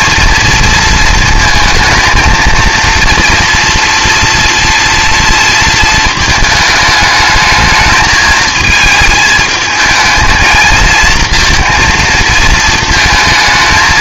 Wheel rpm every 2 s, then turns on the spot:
230, 230, 230, 220, 220, 220, 220.
none